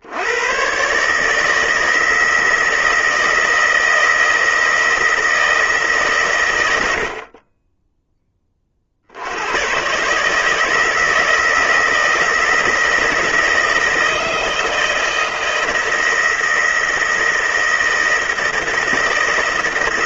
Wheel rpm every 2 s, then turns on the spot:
110, 160, 160, 100, 30, 150, 160, 160, 160, 160.
none